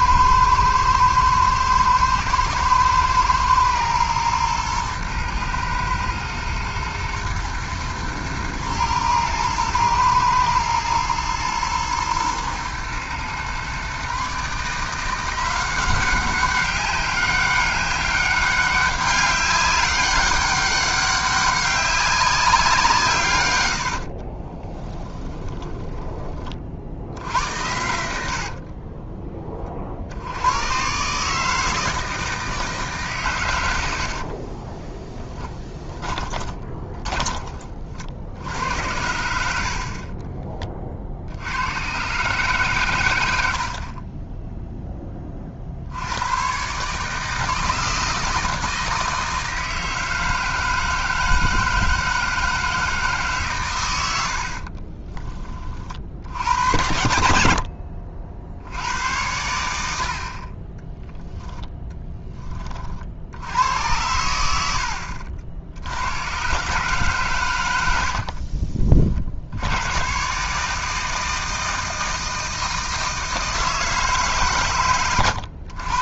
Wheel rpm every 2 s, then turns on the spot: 110, 110, 110, 120, 110, 110, 120, 170, 190, 200, 200, 160, 20, 60, 30, 140, 140, 10, 20, 70, 50, 100, 20, 150, 160, 160, 160, 60, 70, 70, 30, 20, 90, 120, 50, 140, 160, 140.
24-26 28-30 34-36 54-56 68-70